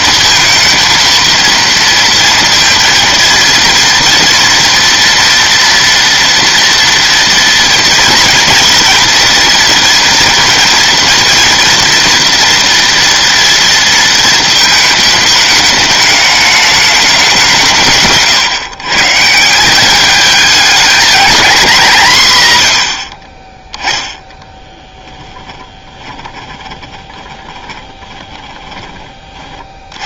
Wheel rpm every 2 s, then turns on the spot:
230, 230, 230, 230, 230, 230, 230, 220, 210, 140, 210, 100, 10, 20, 20.
24-28